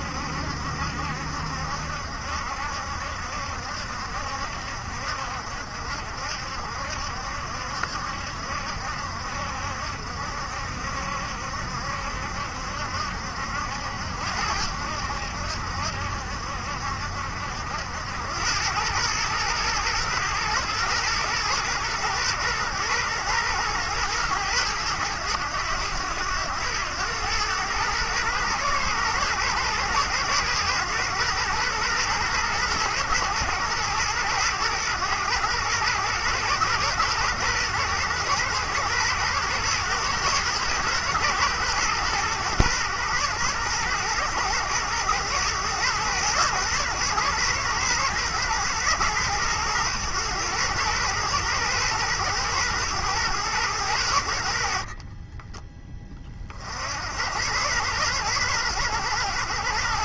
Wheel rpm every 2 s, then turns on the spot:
70, 70, 60, 70, 70, 70, 70, 80, 70, 100, 110, 110, 100, 100, 110, 120, 110, 110, 110, 110, 110, 120, 110, 120, 110, 110, 110, 60, 50, 100.
none